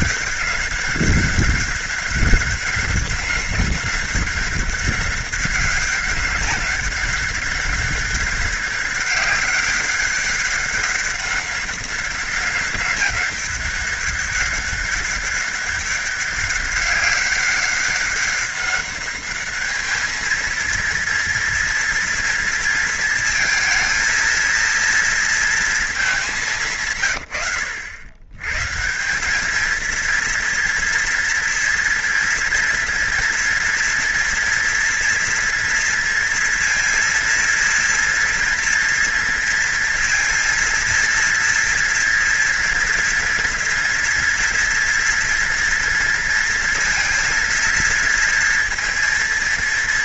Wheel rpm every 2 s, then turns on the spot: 200, 190, 200, 200, 200, 200, 200, 200, 200, 200, 230, 230, 230, 140, 170, 230, 230, 240, 230, 230, 230, 240, 230, 230, 230.
none